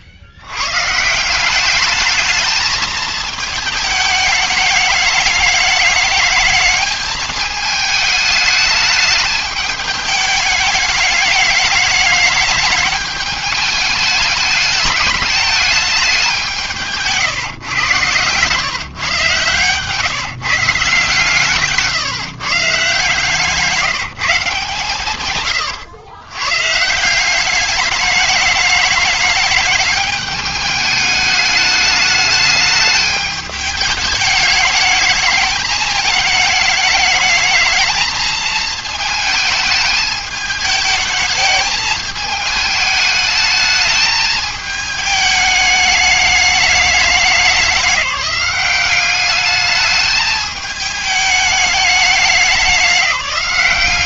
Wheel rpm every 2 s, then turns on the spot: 80, 220, 210, 210, 210, 210, 210, 210, 180, 130, 160, 150, 150, 140, 210, 210, 210, 210, 210, 220, 210, 220, 220, 210, 200, 210, 200.
none